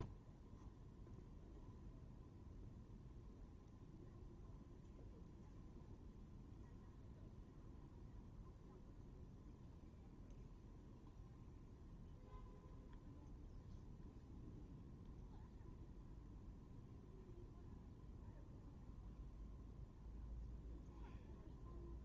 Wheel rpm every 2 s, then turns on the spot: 0, 0, 0, 0, 0, 0, 0, 0, 0, 0, 0.
none